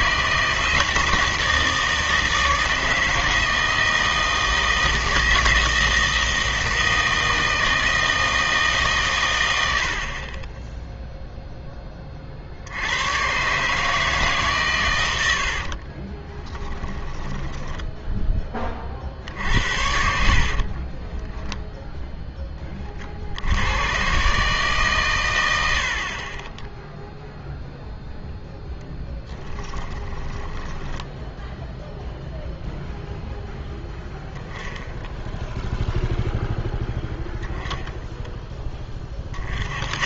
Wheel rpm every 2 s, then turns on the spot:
160, 160, 160, 160, 160, 20, 70, 140, 20, 30, 30, 20, 140, 10, 0, 10, 0, 0, 0, 10.
10-12 16-18 20-22 30-32